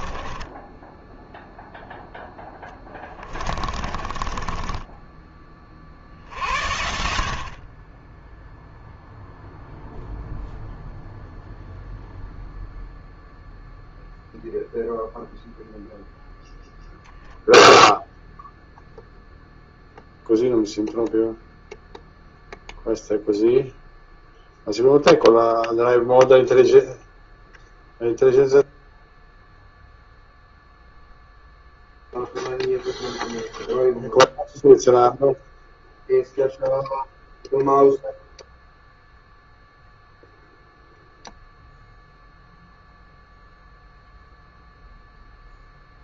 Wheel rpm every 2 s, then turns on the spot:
10, 10, 20, 60, 0, 0, 0, 0, 0, 0, 0, 0, 10, 0, 0, 0, 0, 0, 0, 0, 0, 0, 0.
2-4